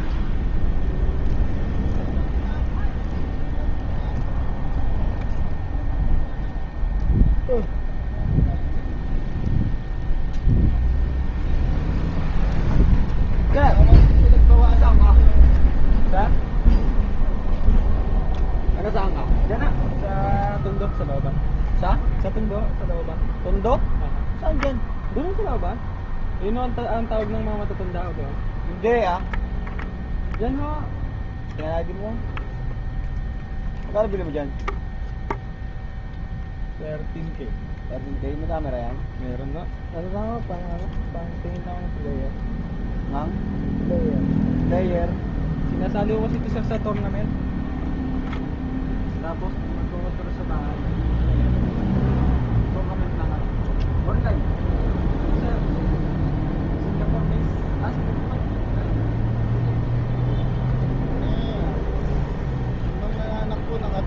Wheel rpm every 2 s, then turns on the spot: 0, 0, 0, 0, 0, 0, 0, 0, 0, 0, 0, 0, 0, 0, 0, 0, 0, 0, 0, 0, 0, 0, 0, 0, 0, 0, 0, 0, 0, 0, 0, 0.
none